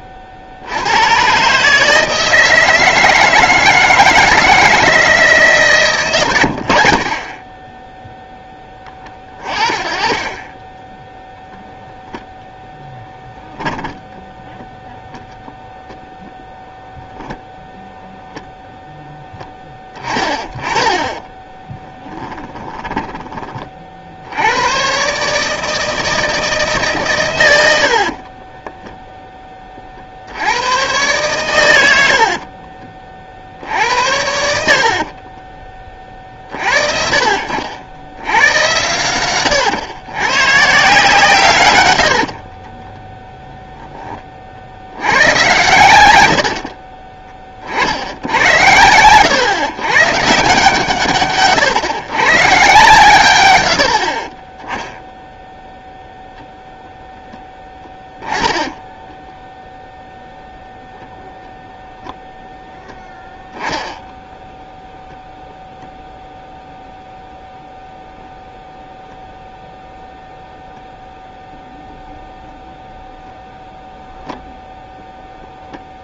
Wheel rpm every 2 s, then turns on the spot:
90, 160, 160, 60, 20, 10, 0, 0, 0, 0, 20, 20, 120, 150, 0, 110, 30, 60, 40, 100, 150, 20, 50, 50, 100, 150, 140, 10, 0, 10, 0, 0, 0, 0, 0, 0, 0, 0.
6-8 20-24 34-36 42-44 46-48 58-60